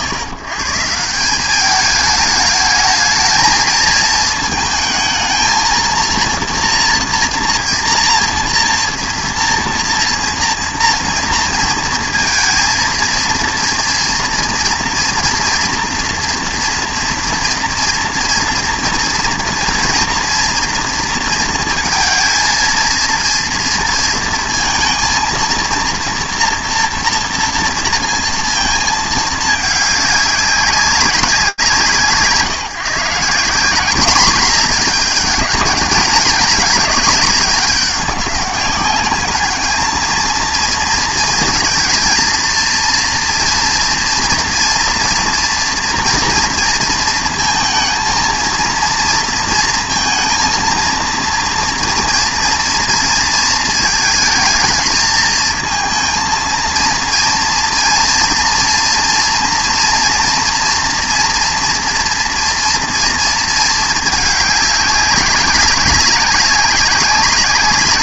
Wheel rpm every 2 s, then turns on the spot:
150, 220, 220, 230, 230, 230, 230, 230, 230, 230, 230, 220, 230, 230, 230, 200, 160, 210, 210, 200, 230, 230, 230, 230, 230, 230, 230, 220, 230, 230, 240, 240, 210, 200.
none